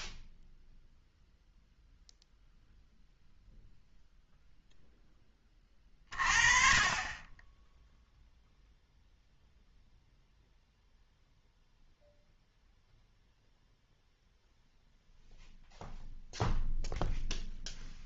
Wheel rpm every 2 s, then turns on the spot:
0, 0, 0, 30, 0, 0, 0, 0, 0.
none